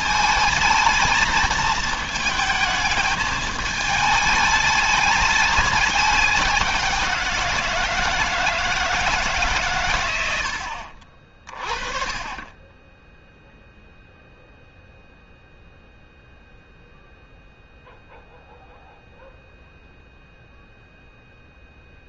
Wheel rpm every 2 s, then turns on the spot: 220, 210, 210, 190, 160, 50, 10, 0, 0, 0, 0.
none